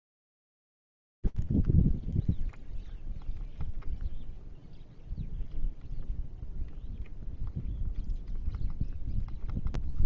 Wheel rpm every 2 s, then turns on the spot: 0, 0, 0, 0, 0.
none